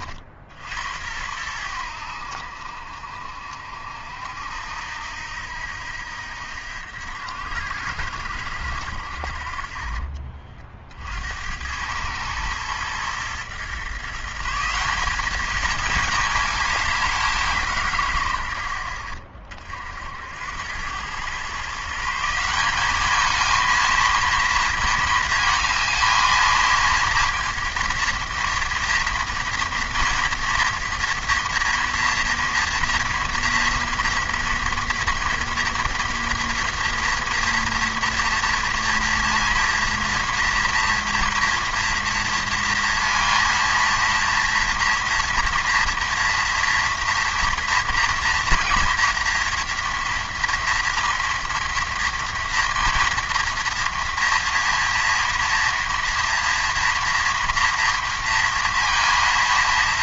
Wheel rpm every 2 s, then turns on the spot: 70, 60, 80, 80, 70, 40, 110, 170, 210, 70, 90, 190, 230, 220, 230, 240, 230, 230, 230, 230, 230, 230, 230, 230, 230, 230, 230, 230, 230, 230.
none